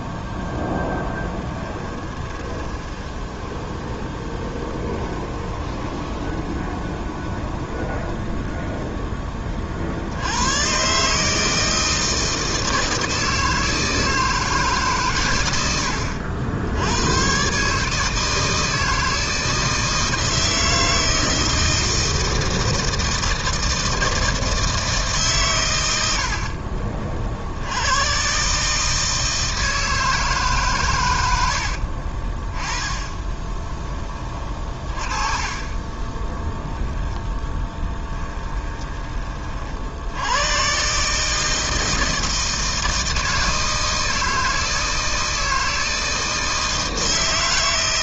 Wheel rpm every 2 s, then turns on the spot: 10, 10, 10, 20, 0, 110, 160, 150, 80, 160, 160, 160, 160, 50, 150, 140, 20, 30, 0, 20, 130, 160, 160, 160.
0-8 32-34 38-40